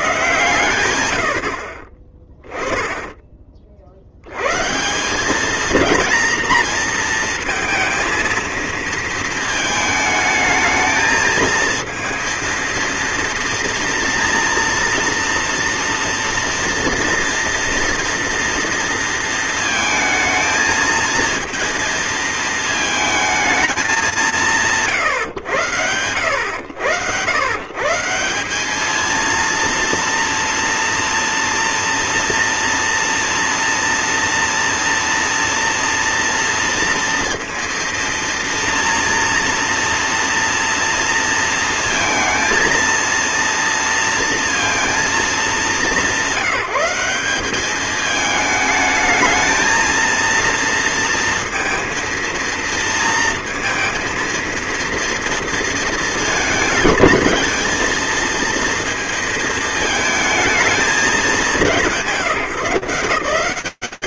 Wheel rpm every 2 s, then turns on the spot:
130, 20, 80, 230, 230, 220, 230, 230, 230, 240, 220, 230, 180, 100, 190, 230, 230, 230, 230, 230, 230, 230, 230, 190, 220, 230, 230, 230, 220, 230, 220, 180.
none